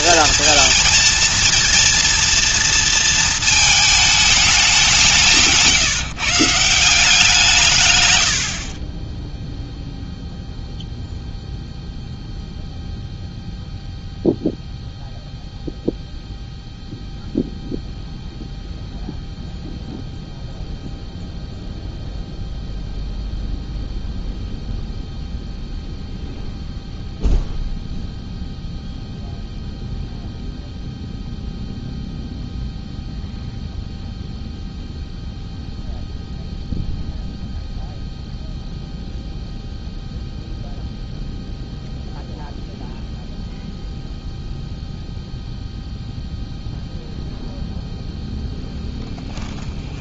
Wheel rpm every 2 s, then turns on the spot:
230, 230, 200, 150, 50, 0, 0, 0, 0, 0, 0, 0, 0, 0, 0, 0, 0, 0, 0, 0, 0, 0, 0, 0, 0.
none